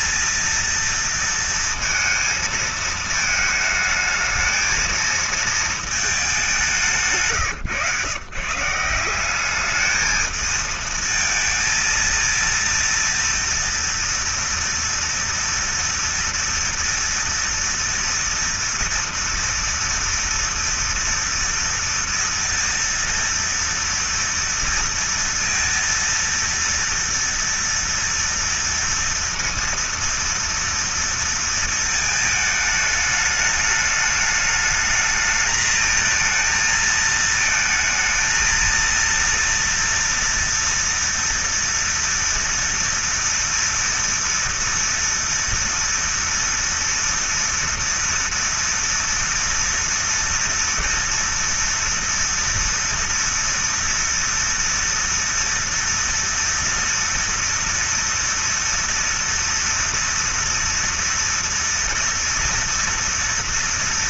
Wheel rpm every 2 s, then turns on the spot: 230, 230, 220, 200, 140, 220, 230, 230, 230, 230, 230, 230, 230, 230, 230, 230, 220, 210, 220, 230, 230, 230, 230, 230, 230, 230, 230, 230, 230, 230, 230, 230.
none